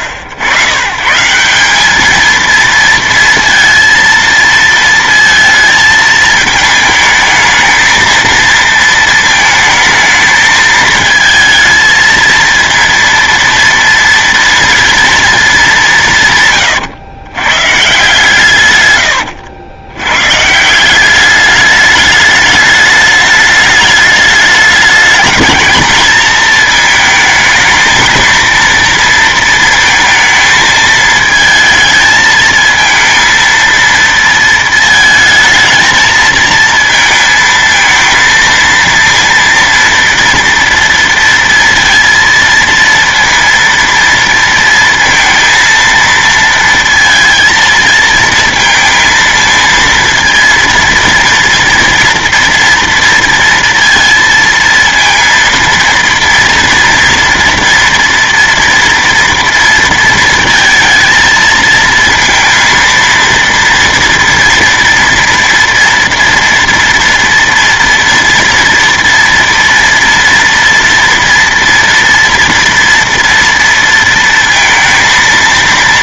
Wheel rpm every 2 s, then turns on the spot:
110, 230, 230, 220, 230, 220, 230, 230, 130, 130, 150, 210, 210, 220, 230, 220, 220, 230, 220, 230, 230, 230, 230, 230, 220, 230, 230, 230, 230, 230, 230, 230, 240, 230, 230, 230, 230, 230.
none